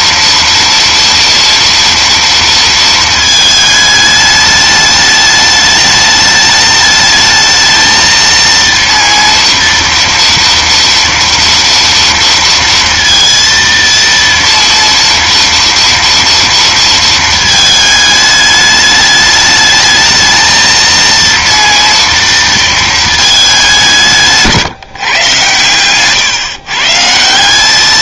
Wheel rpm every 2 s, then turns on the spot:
240, 230, 210, 210, 230, 230, 230, 230, 230, 210, 230, 230, 160, 140.
none